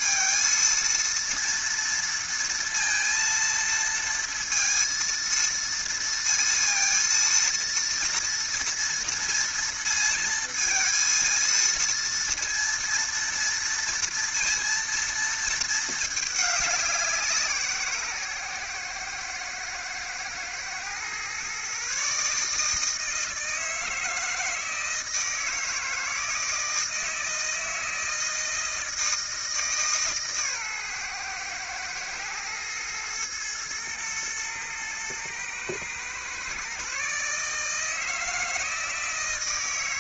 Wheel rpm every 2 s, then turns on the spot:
230, 230, 230, 230, 230, 220, 230, 230, 200, 130, 120, 150, 160, 160, 160, 140, 110, 110, 130, 160.
none